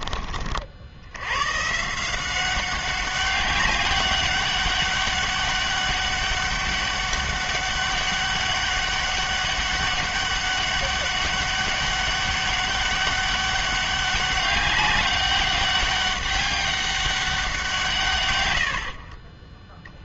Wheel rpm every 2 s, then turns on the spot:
60, 190, 200, 200, 200, 200, 200, 200, 200, 80.
none